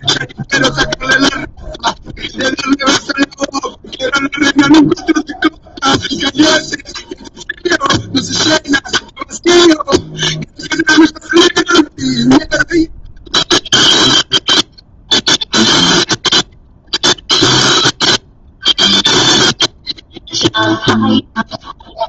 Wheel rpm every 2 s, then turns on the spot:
0, 0, 0, 0, 0, 0, 0, 0, 0, 0, 0.
none